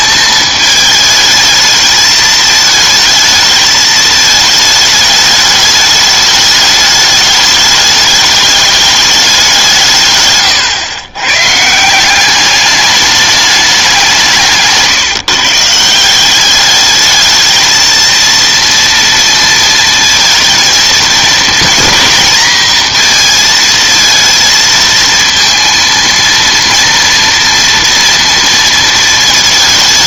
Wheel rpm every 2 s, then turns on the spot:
220, 220, 210, 210, 210, 120, 200, 160, 210, 230, 230, 230, 230, 230, 230.
14-16